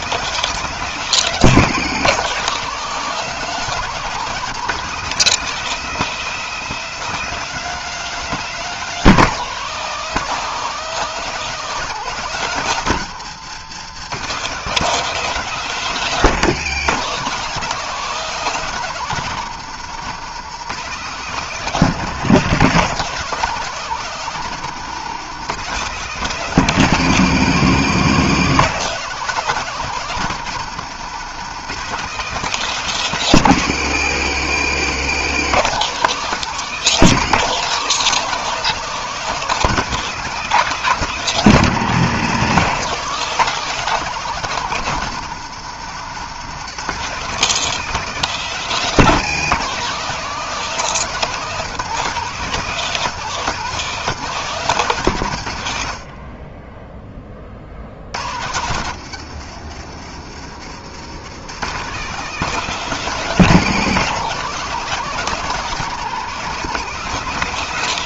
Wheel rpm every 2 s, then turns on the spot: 190, 200, 200, 210, 190, 200, 150, 200, 180, 180, 180, 190, 180, 170, 190, 180, 180, 160, 180, 190, 190, 190, 160, 190, 180, 180, 190, 140, 30, 120, 140, 190, 200, 190.
none